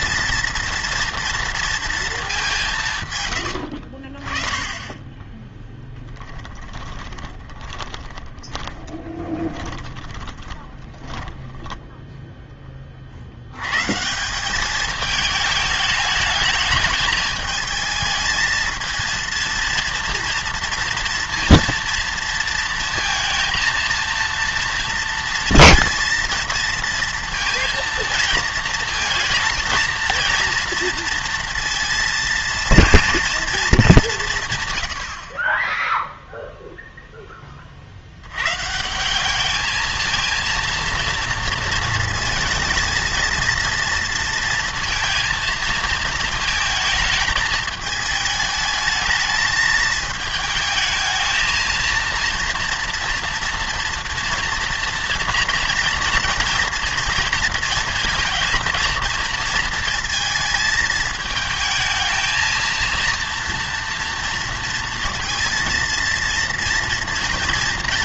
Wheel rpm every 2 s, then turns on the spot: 230, 180, 20, 20, 20, 30, 20, 200, 210, 220, 230, 230, 230, 230, 230, 230, 230, 130, 0, 140, 230, 220, 230, 220, 220, 220, 230, 240, 230, 220, 220, 230, 230, 230.
6-12